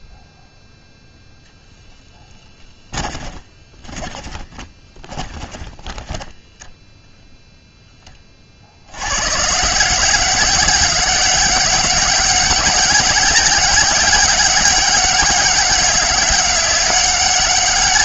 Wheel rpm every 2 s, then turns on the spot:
0, 20, 20, 0, 70, 190, 200, 200, 200.
2-6